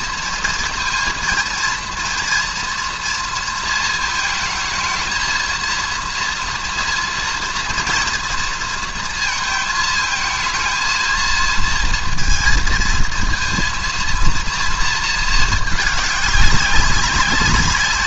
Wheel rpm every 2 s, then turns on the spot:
230, 230, 220, 230, 230, 220, 230, 230, 200.
none